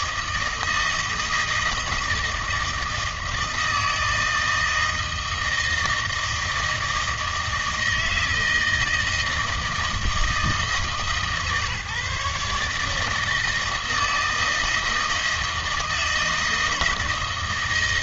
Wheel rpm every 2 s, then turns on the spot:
160, 160, 160, 160, 160, 160, 150, 160, 160.
none